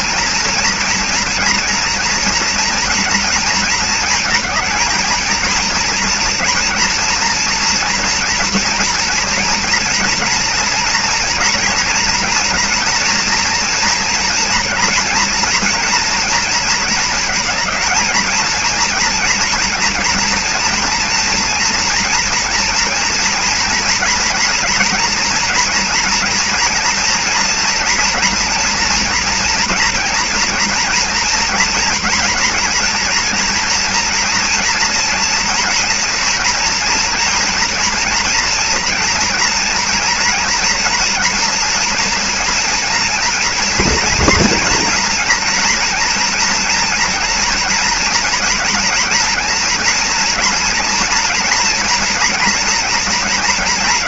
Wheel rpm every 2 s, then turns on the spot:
230, 230, 220, 240, 240, 230, 240, 230, 230, 230, 230, 230, 230, 230, 230, 230, 230, 240, 240, 230, 230, 230, 230, 230, 230, 230, 230.
none